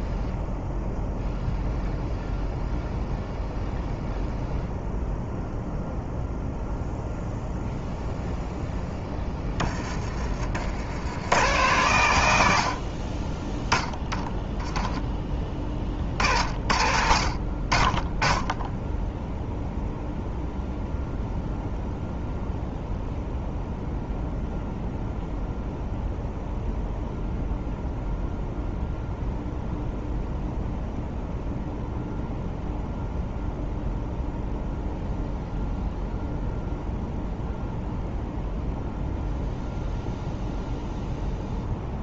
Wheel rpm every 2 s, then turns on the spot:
0, 0, 0, 0, 0, 70, 70, 10, 60, 10, 0, 0, 0, 0, 0, 0, 0, 0, 0, 0, 0.
none